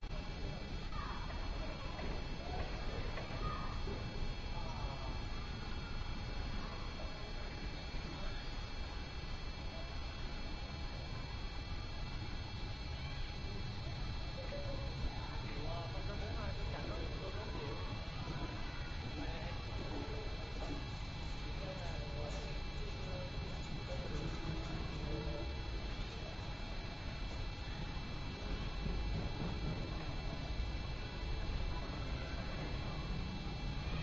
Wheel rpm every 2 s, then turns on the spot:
0, 0, 0, 0, 0, 0, 0, 0, 0, 0, 0, 0, 0, 0, 0, 0, 0.
none